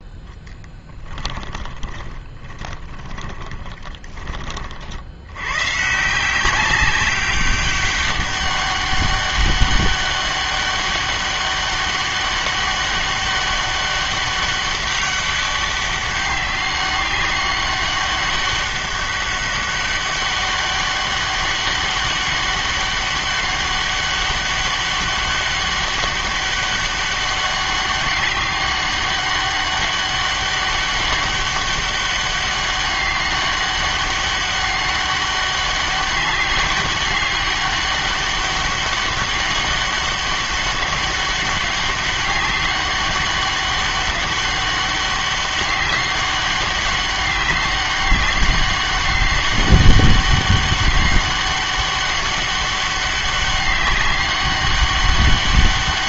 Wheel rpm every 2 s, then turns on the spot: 10, 20, 50, 190, 200, 200, 200, 200, 190, 200, 200, 200, 200, 200, 200, 200, 200, 200, 200, 200, 190, 200, 200, 200, 200, 200, 200, 200.
2-4